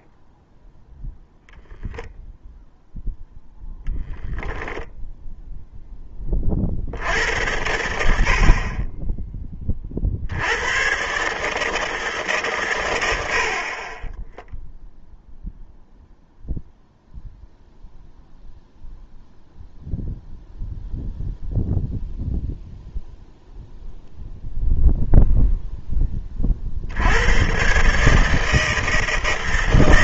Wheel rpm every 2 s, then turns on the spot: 0, 0, 10, 50, 20, 110, 130, 0, 0, 0, 0, 0, 0, 50, 160.
none